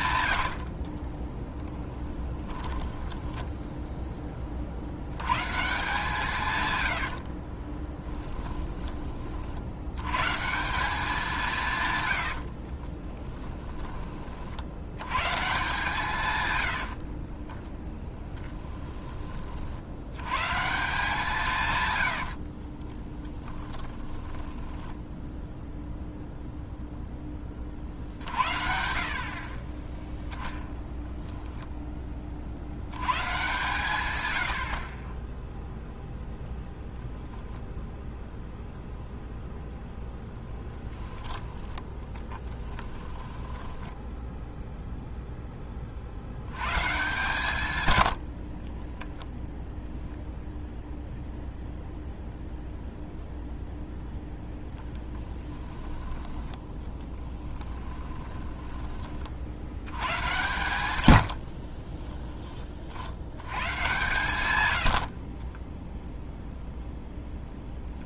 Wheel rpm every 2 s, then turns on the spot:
50, 20, 70, 120, 20, 180, 30, 90, 60, 10, 160, 30, 10, 0, 50, 0, 90, 50, 0, 0, 10, 20, 0, 130, 20, 0, 0, 10, 10, 20, 110, 60, 80, 0.
0-4 6-8 12-14 16-18 22-26 42-44 48-50 54-58 60-62 64-66